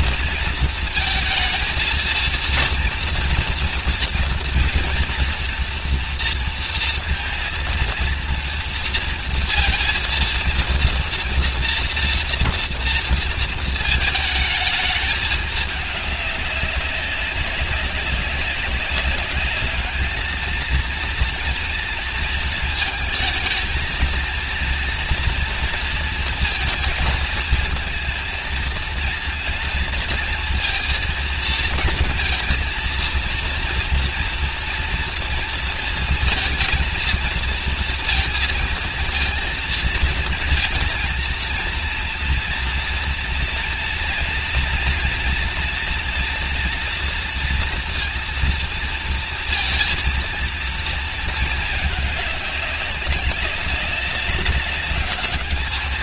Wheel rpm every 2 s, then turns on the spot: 220, 230, 230, 230, 230, 230, 230, 220, 200, 190, 230, 230, 230, 230, 230, 230, 230, 230, 230, 230, 230, 230, 230, 230, 230, 230, 190, 200.
none